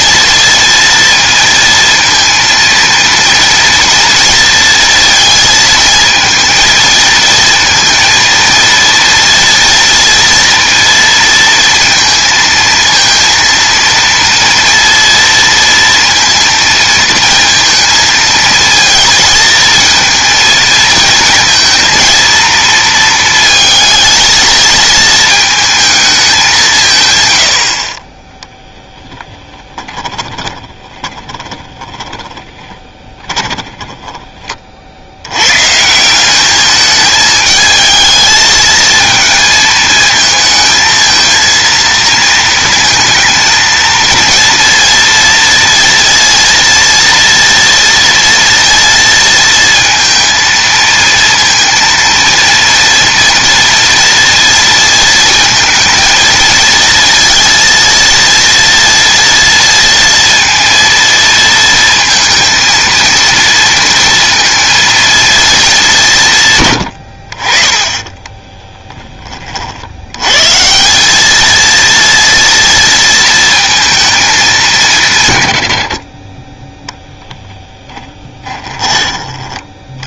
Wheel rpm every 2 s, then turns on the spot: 230, 230, 230, 230, 230, 230, 230, 230, 230, 220, 230, 230, 220, 150, 20, 20, 20, 50, 210, 220, 220, 230, 240, 230, 230, 230, 230, 230, 230, 230, 230, 230, 230, 100, 10, 170, 230, 170, 10, 20.
28-34 78-80